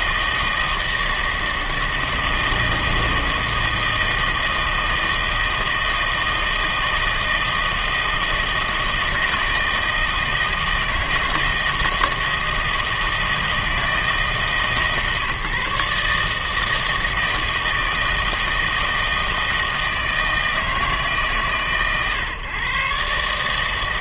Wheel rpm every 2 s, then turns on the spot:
160, 160, 160, 160, 160, 160, 160, 140, 160, 160, 150, 140.
none